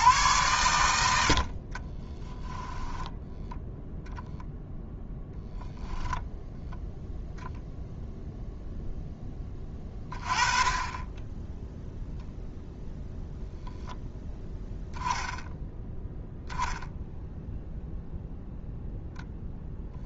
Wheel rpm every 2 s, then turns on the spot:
100, 10, 0, 0, 0, 20, 0, 0, 0, 0.
none